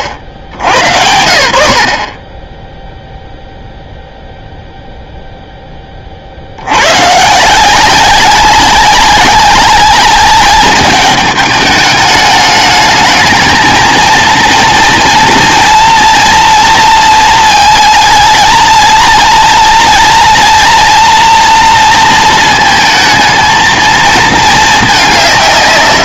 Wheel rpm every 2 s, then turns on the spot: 90, 0, 0, 90, 200, 200, 210, 230, 230, 230, 240, 230, 210.
none